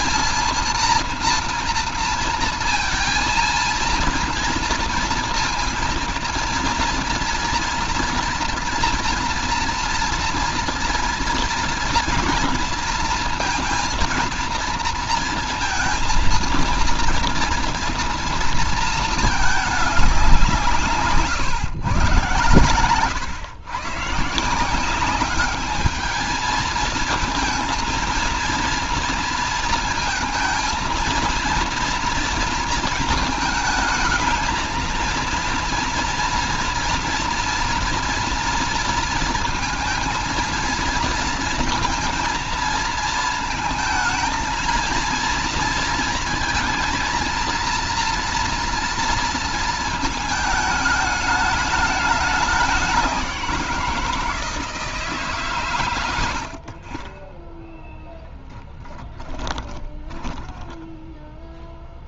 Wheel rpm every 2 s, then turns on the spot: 230, 230, 230, 230, 230, 230, 230, 230, 230, 230, 190, 130, 160, 220, 230, 230, 230, 220, 230, 230, 230, 230, 220, 230, 240, 220, 200, 160, 90, 10, 20.
58-62